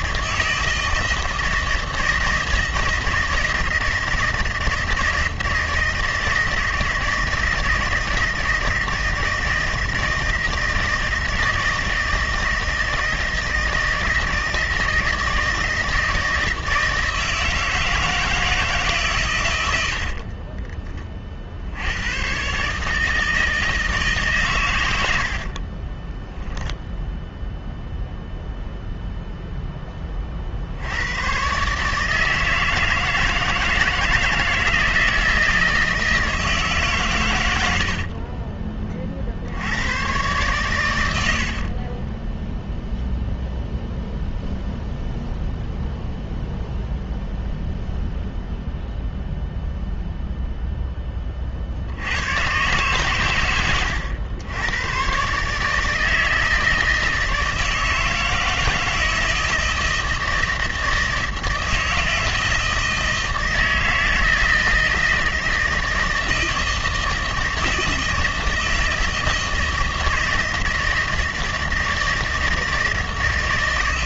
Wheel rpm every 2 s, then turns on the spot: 160, 160, 160, 160, 160, 160, 160, 160, 160, 160, 20, 140, 140, 10, 0, 60, 160, 160, 160, 40, 110, 0, 0, 0, 0, 0, 130, 100, 160, 160, 160, 160, 160, 160, 160, 160, 160.
20-22 26-28 38-40